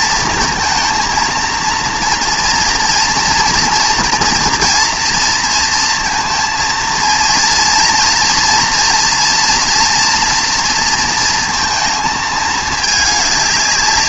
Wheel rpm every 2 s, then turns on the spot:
230, 230, 230, 230, 240, 240, 210.
none